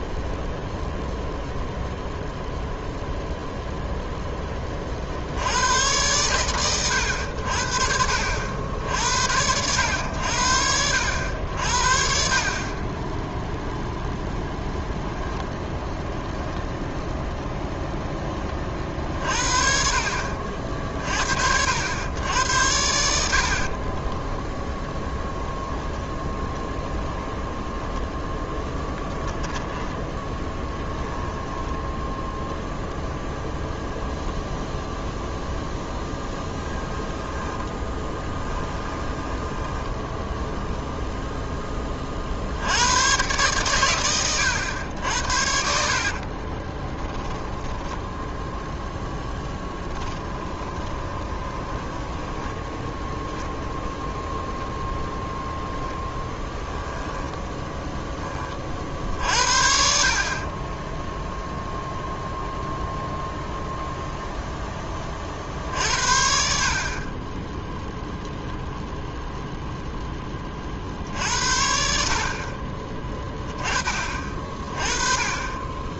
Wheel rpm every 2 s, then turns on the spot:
0, 0, 30, 110, 80, 80, 30, 0, 0, 40, 50, 80, 0, 10, 10, 10, 0, 0, 10, 20, 10, 90, 80, 20, 10, 20, 10, 10, 10, 40, 10, 0, 10, 50, 10, 40, 30, 30.
26-32 38-40 46-48 50-52 60-62